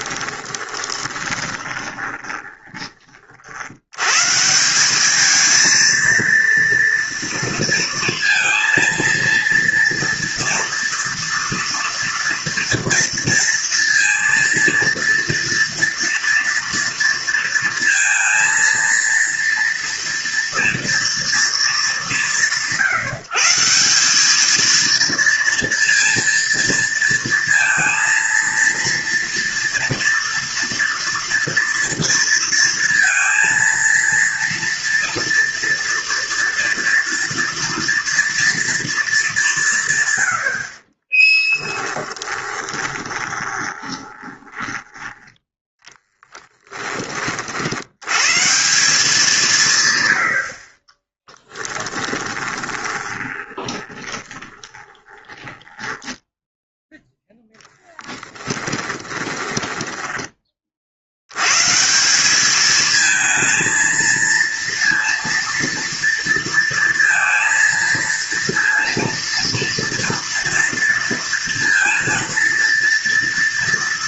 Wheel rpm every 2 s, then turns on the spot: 20, 30, 190, 230, 230, 240, 230, 230, 230, 230, 240, 160, 230, 230, 230, 230, 230, 230, 230, 230, 50, 20, 10, 10, 180, 40, 20, 20, 0, 10, 50, 220, 230, 230, 230, 230, 230.
0-2 42-46 50-56 58-60